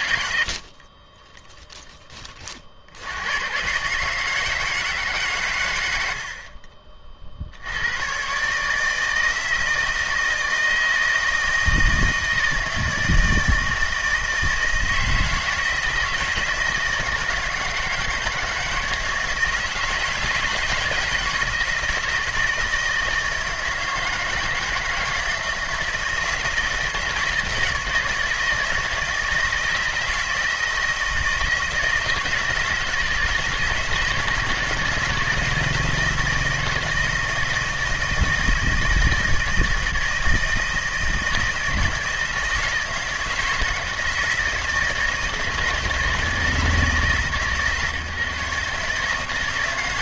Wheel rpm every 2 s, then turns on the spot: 50, 70, 160, 40, 150, 160, 160, 160, 160, 160, 160, 160, 160, 160, 160, 160, 160, 170, 160, 160, 160, 160, 160, 160, 150.
0-2